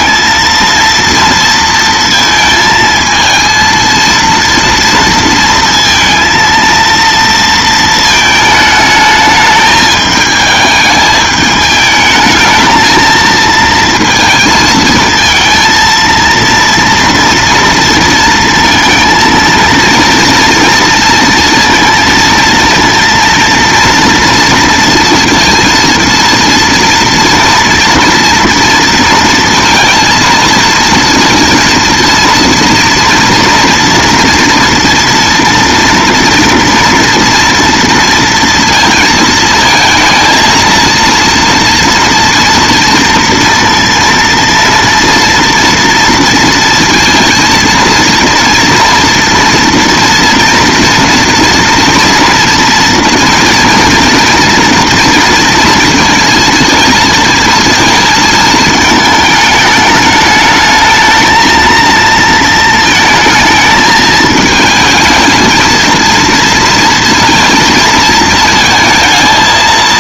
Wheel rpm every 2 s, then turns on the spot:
230, 220, 230, 230, 220, 210, 220, 220, 230, 230, 230, 230, 230, 230, 230, 230, 230, 240, 230, 230, 230, 230, 230, 230, 230, 230, 230, 230, 230, 220, 220, 220, 220, 230, 220.
none